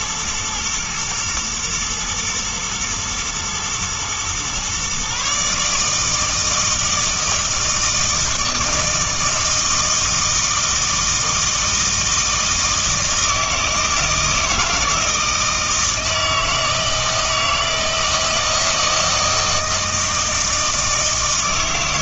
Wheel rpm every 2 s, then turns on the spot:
120, 110, 130, 160, 160, 160, 160, 160, 160, 160, 160.
none